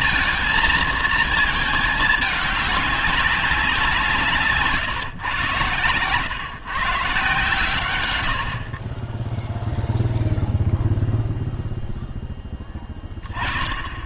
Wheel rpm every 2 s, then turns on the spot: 220, 210, 150, 140, 60, 0, 10.
none